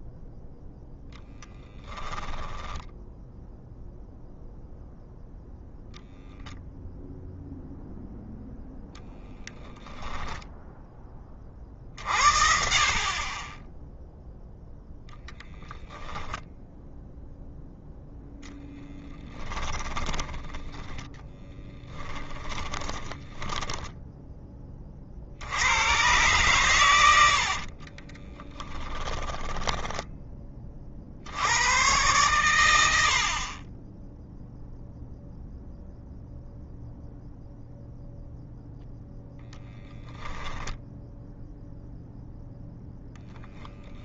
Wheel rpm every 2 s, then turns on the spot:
0, 10, 0, 0, 0, 10, 40, 0, 0, 0, 10, 10, 30, 110, 10, 50, 90, 0, 0, 0, 10, 0.
22-24 28-30